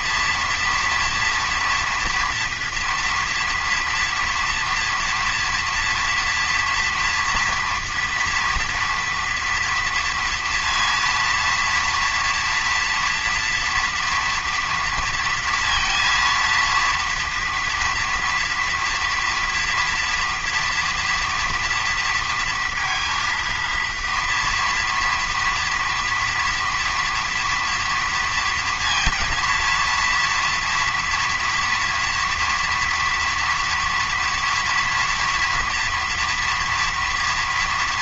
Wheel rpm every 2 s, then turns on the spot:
230, 230, 230, 230, 230, 230, 230, 230, 230, 240, 230, 230, 230, 230, 230, 230, 230, 230, 230.
none